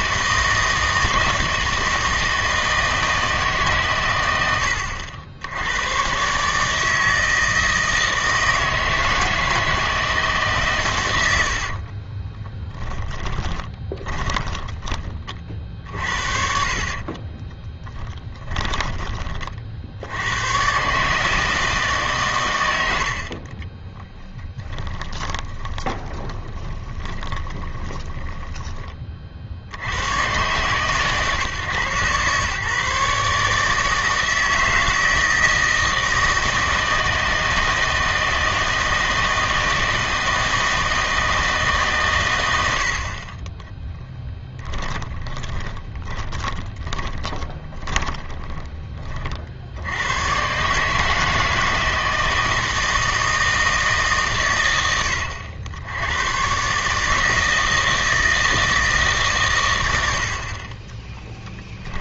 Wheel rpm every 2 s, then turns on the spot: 160, 160, 90, 150, 160, 140, 10, 20, 60, 20, 120, 100, 10, 20, 20, 130, 140, 160, 160, 160, 160, 80, 20, 20, 20, 140, 160, 110, 130, 160, 30.
12-20 24-28 44-48